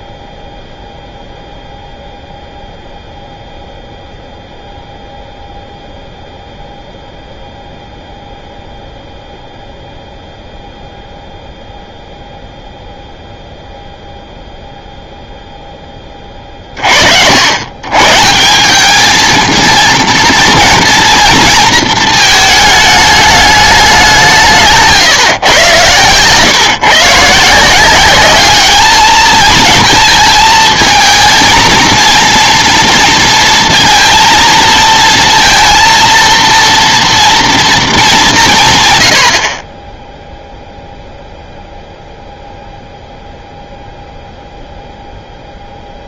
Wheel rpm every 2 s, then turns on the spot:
0, 0, 0, 0, 0, 0, 0, 0, 40, 200, 230, 220, 140, 140, 210, 220, 230, 230, 230, 140, 0, 0, 0.
none